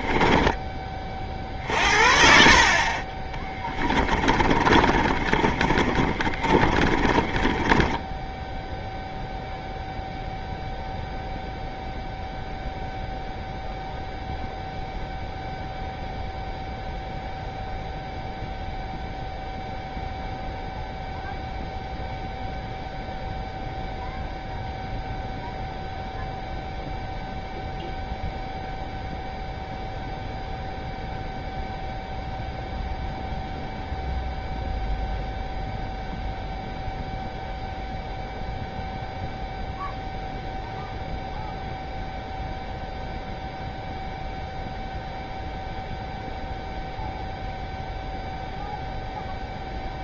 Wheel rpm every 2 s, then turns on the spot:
20, 40, 30, 30, 0, 0, 0, 0, 0, 0, 0, 0, 0, 0, 0, 0, 0, 0, 0, 0, 0, 0, 0, 0, 0.
2-8